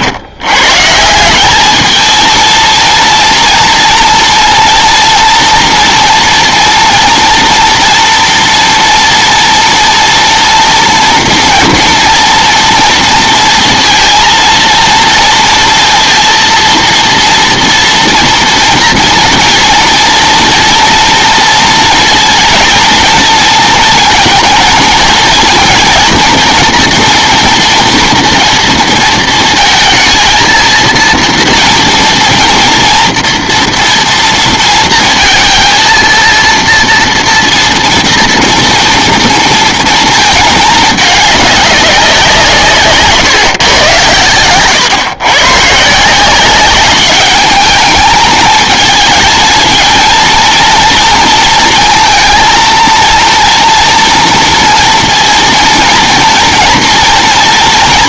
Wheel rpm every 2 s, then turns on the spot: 140, 230, 230, 230, 230, 230, 230, 230, 230, 230, 230, 230, 230, 230, 230, 230, 240, 230, 230, 230, 210, 150, 120, 200, 220, 230, 230, 230, 230.
none